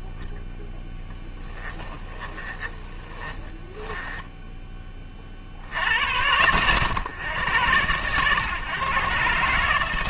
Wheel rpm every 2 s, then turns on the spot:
40, 20, 10, 100, 130.
2-4